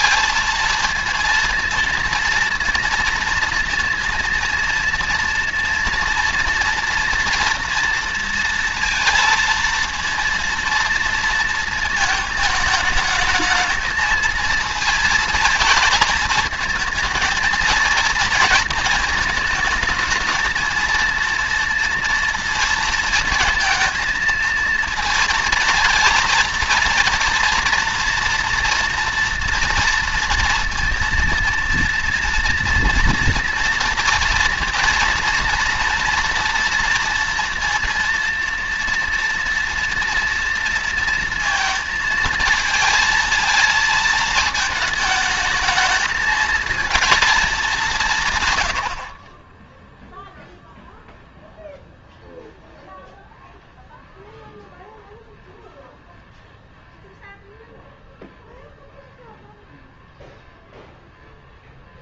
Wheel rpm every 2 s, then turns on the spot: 230, 230, 230, 230, 230, 230, 220, 220, 230, 230, 220, 230, 230, 230, 230, 230, 240, 230, 230, 230, 230, 230, 220, 220, 150, 0, 0, 0, 0, 0, 0.
none